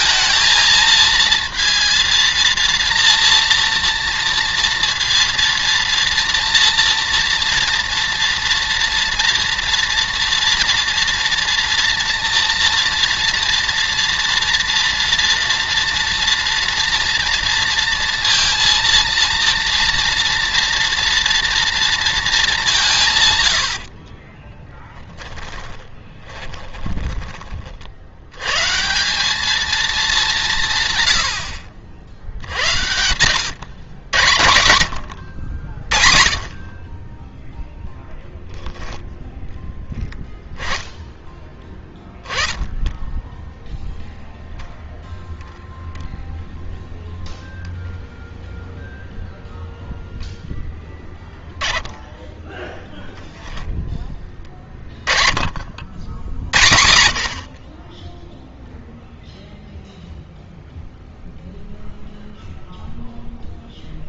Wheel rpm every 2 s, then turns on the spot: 220, 230, 230, 230, 230, 230, 230, 230, 230, 230, 230, 190, 20, 20, 130, 160, 90, 80, 40, 10, 10, 10, 0, 0, 0, 0, 10, 30, 90, 0, 0, 0.
24-28